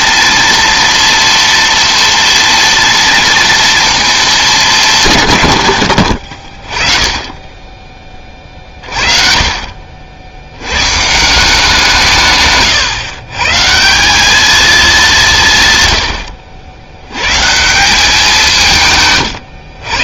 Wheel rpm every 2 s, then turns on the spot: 230, 230, 210, 40, 30, 100, 140, 210, 80, 160.
none